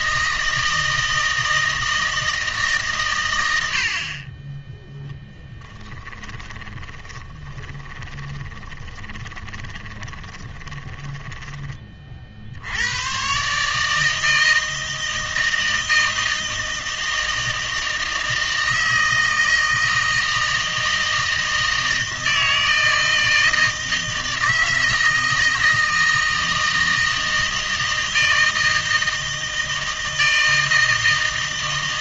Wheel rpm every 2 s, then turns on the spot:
160, 140, 10, 20, 20, 20, 90, 160, 160, 160, 160, 160, 160, 160, 160, 160.
6-12